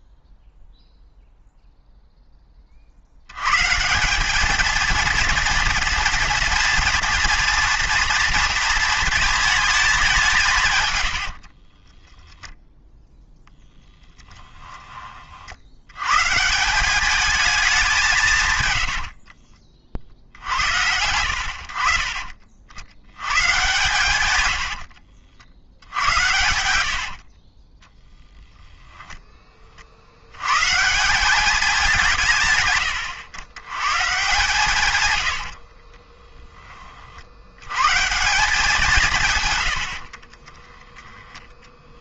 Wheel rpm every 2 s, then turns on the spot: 0, 40, 220, 230, 230, 140, 0, 10, 170, 120, 90, 50, 80, 80, 0, 130, 120, 150, 20, 190, 10.
24-28 34-36 40-42